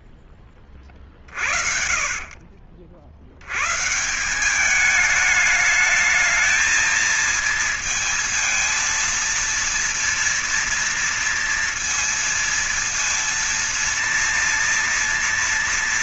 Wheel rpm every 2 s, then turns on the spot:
30, 60, 200, 220, 230, 230, 230, 230.
none